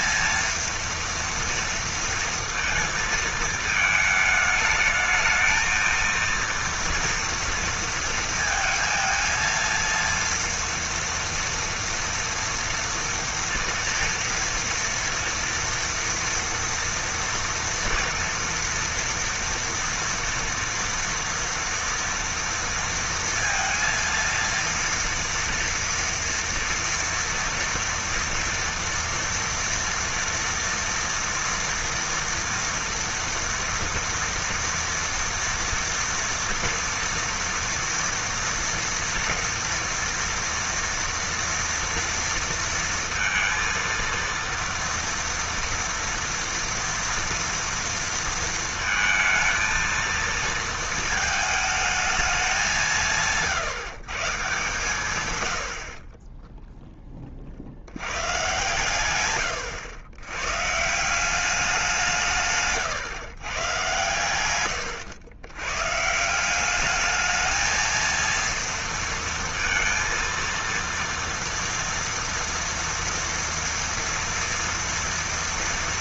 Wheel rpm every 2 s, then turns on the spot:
230, 230, 210, 230, 230, 230, 230, 230, 230, 230, 240, 230, 230, 230, 230, 240, 230, 230, 230, 230, 230, 230, 230, 230, 230, 230, 200, 160, 10, 120, 130, 150, 110, 190, 230, 230, 230, 230.
56-58